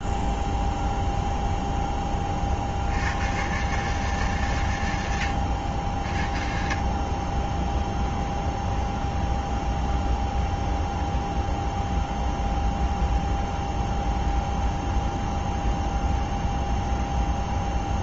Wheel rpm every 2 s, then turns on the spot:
0, 70, 110, 30, 0, 0, 0, 0, 0.
none